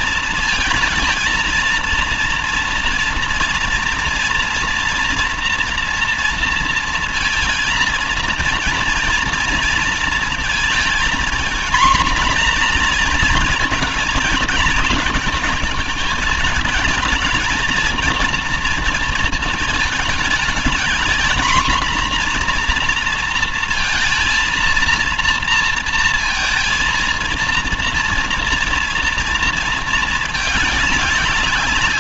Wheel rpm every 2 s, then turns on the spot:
230, 230, 230, 230, 230, 230, 240, 220, 220, 230, 220, 240, 230, 230, 230, 210.
none